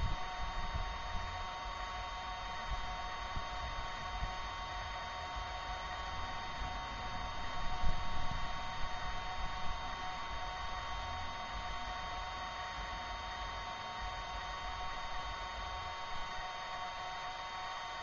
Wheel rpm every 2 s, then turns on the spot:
0, 0, 0, 0, 0, 0, 0, 0, 0.
none